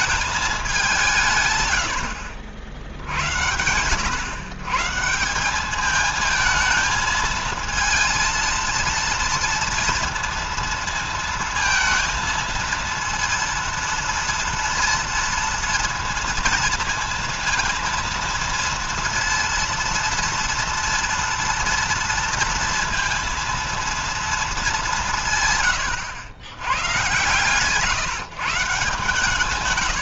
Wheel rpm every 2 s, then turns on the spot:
190, 70, 120, 220, 230, 230, 230, 230, 230, 230, 230, 230, 210, 100, 150.
none